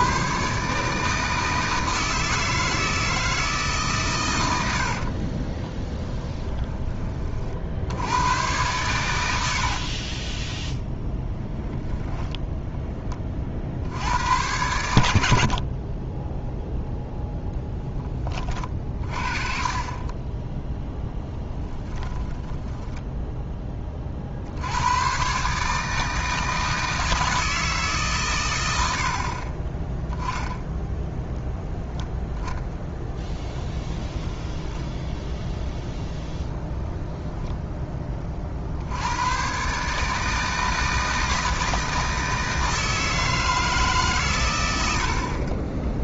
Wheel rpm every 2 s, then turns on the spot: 150, 160, 60, 20, 110, 10, 10, 90, 0, 30, 10, 10, 90, 160, 90, 0, 10, 10, 10, 70, 160, 160, 80.
4-6 22-24 32-36